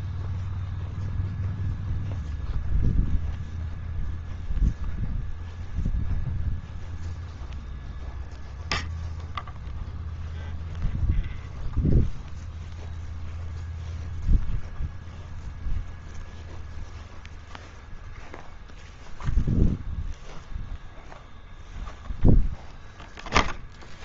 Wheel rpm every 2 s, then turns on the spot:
0, 0, 0, 0, 0, 0, 0, 0, 0, 0, 0, 0.
none